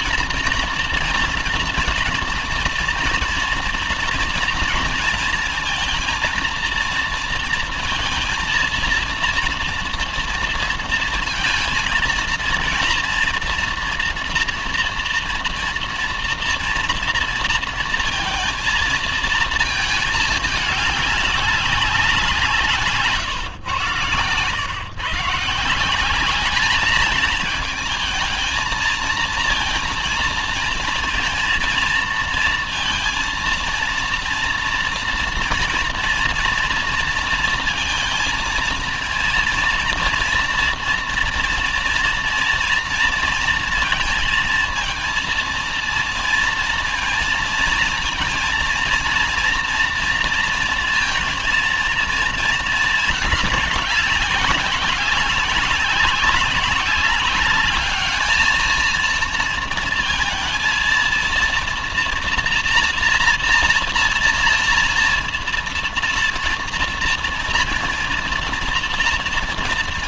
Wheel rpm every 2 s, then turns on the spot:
230, 230, 230, 230, 230, 230, 230, 230, 230, 230, 210, 170, 120, 210, 220, 230, 230, 240, 230, 230, 230, 230, 230, 230, 230, 230, 220, 190, 190, 220, 230, 230, 230, 230, 230.
none